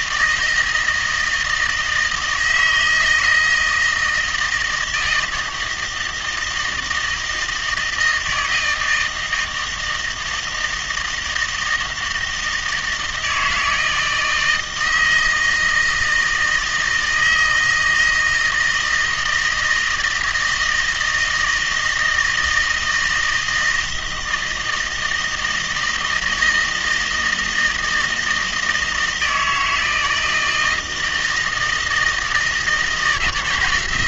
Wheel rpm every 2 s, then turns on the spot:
160, 160, 160, 160, 160, 170, 160, 160, 160, 160, 160, 160, 160, 160, 160, 160, 160.
none